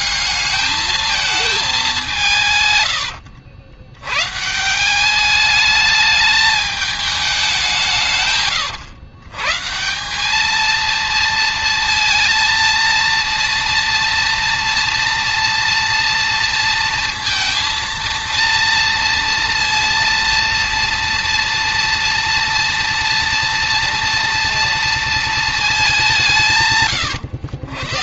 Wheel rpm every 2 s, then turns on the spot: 220, 120, 190, 200, 110, 230, 230, 230, 230, 230, 230, 230, 230, 130.
2-4